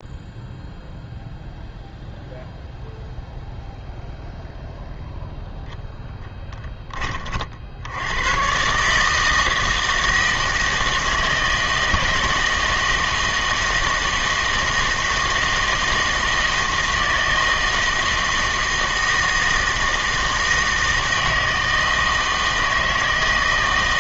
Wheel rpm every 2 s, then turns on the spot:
0, 0, 0, 10, 130, 160, 160, 160, 160, 160, 160, 160.
none